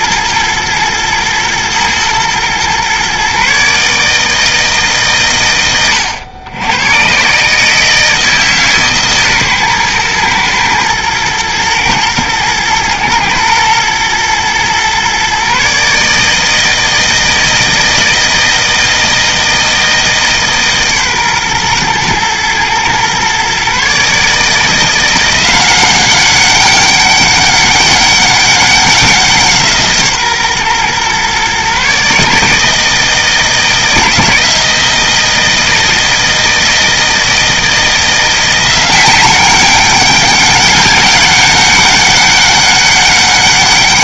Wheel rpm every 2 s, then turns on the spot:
110, 120, 150, 100, 150, 110, 110, 120, 160, 160, 140, 120, 160, 200, 190, 130, 160, 170, 160, 180, 200, 200.
none